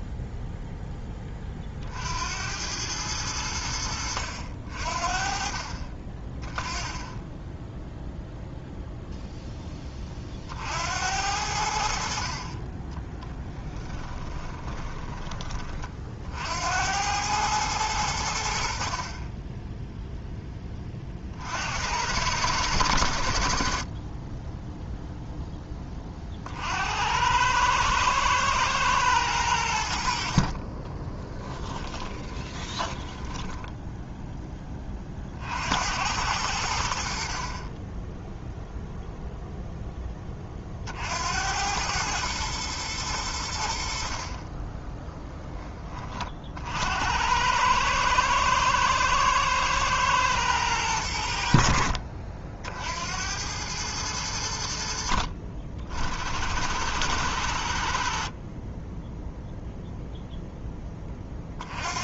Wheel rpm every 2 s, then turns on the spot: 0, 90, 60, 10, 0, 50, 30, 20, 80, 70, 10, 100, 10, 60, 110, 40, 20, 20, 80, 0, 30, 110, 20, 60, 110, 110, 60, 90, 90, 30, 10.
14-16 30-34